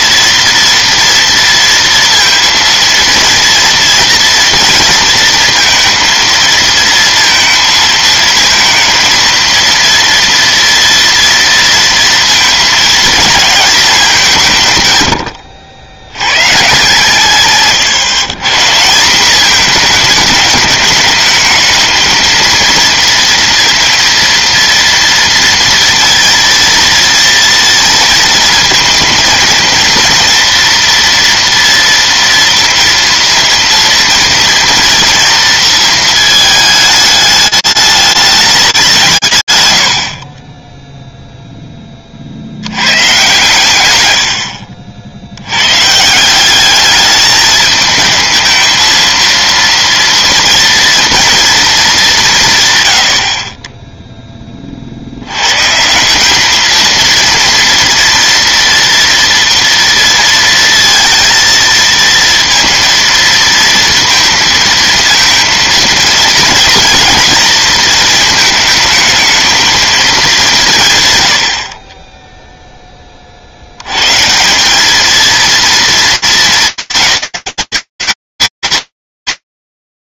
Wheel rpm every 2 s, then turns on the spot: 240, 230, 230, 230, 220, 230, 220, 150, 130, 150, 210, 230, 230, 230, 230, 230, 230, 230, 220, 200, 10, 100, 80, 200, 220, 230, 120, 70, 230, 230, 230, 230, 230, 230, 220, 150, 20, 210, 220, 230.
none